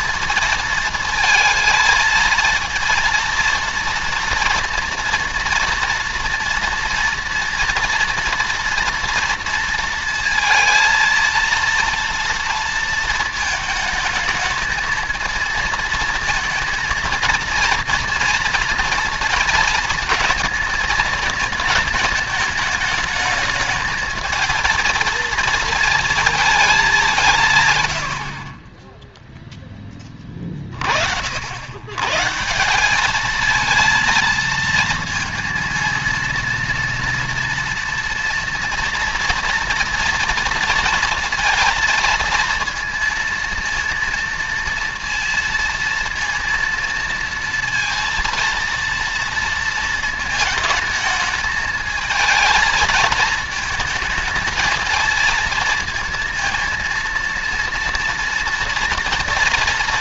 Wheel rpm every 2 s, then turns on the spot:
230, 230, 230, 230, 230, 230, 230, 220, 230, 230, 220, 210, 230, 200, 20, 30, 190, 230, 240, 230, 230, 230, 230, 230, 230, 220, 220, 220, 230, 230.
28-30